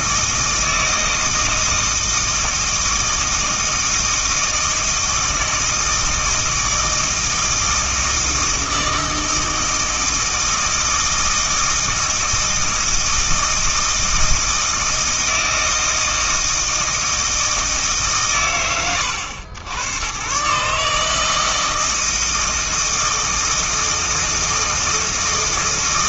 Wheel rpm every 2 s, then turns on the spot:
160, 160, 160, 160, 160, 160, 160, 160, 160, 60, 150, 160, 160.
none